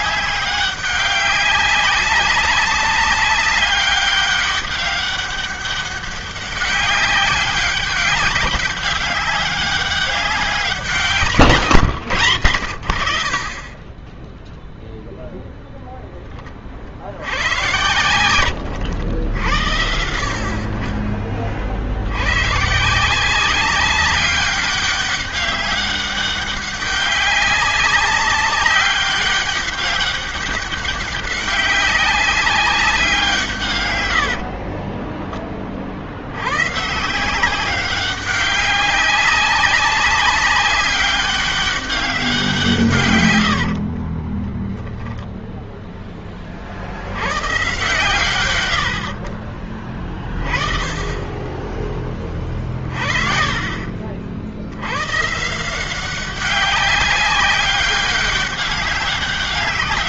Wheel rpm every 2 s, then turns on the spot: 200, 190, 200, 190, 200, 190, 90, 0, 30, 100, 60, 100, 200, 200, 200, 200, 190, 80, 90, 200, 200, 180, 40, 20, 110, 40, 20, 50, 190, 200.
34-36 44-46 48-50